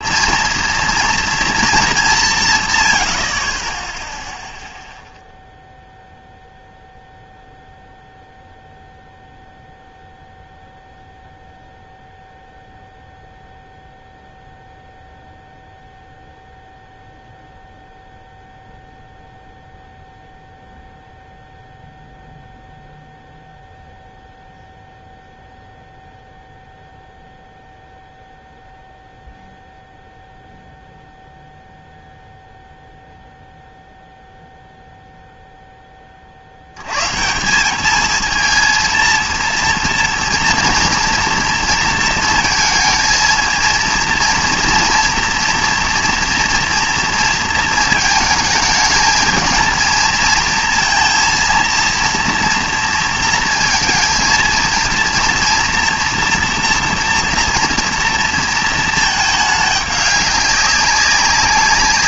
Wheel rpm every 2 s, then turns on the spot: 230, 120, 0, 0, 0, 0, 0, 0, 0, 0, 0, 0, 0, 0, 0, 0, 0, 0, 90, 230, 230, 230, 230, 230, 220, 230, 230, 230, 240, 230, 190.
none